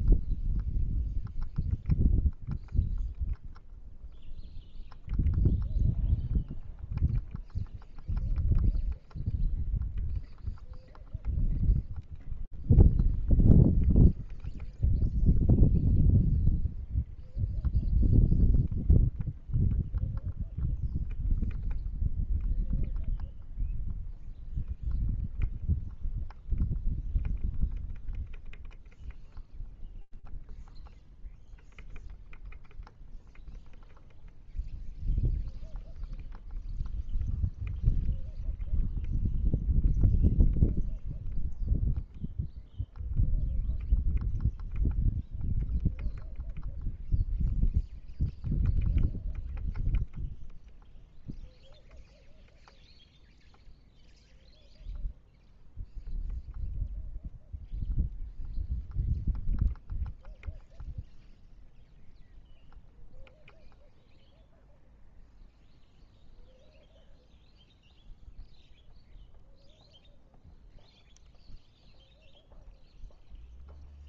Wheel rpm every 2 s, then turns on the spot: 0, 0, 0, 0, 0, 0, 0, 0, 0, 0, 0, 0, 0, 0, 0, 0, 0, 0, 0, 0, 0, 0, 0, 0, 0, 0, 0, 0, 0, 0, 0, 0, 0, 0, 0, 0, 0.
none